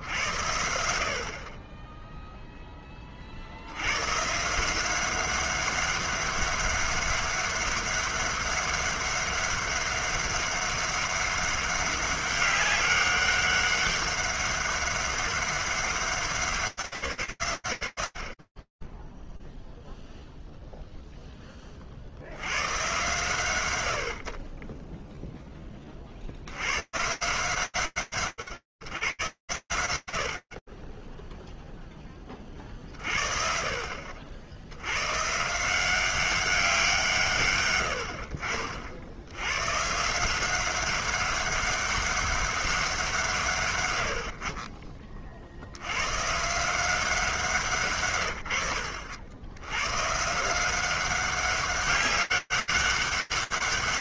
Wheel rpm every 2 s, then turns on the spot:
60, 90, 200, 200, 200, 200, 200, 200, 160, 20, 0, 90, 40, 110, 120, 60, 30, 80, 190, 70, 190, 190, 70, 170, 100, 190, 200.
none